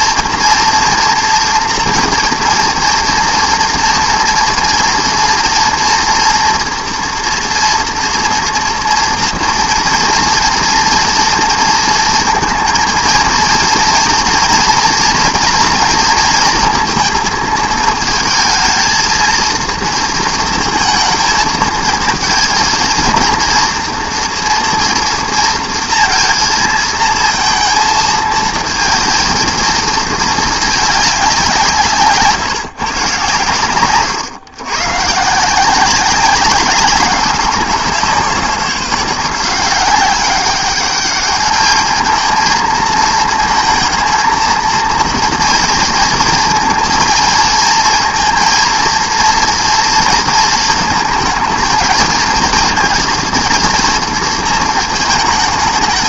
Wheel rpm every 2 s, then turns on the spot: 230, 230, 230, 230, 230, 230, 230, 240, 230, 230, 230, 230, 230, 220, 220, 210, 130, 130, 190, 180, 200, 220, 230, 230, 230, 230, 230, 220.
none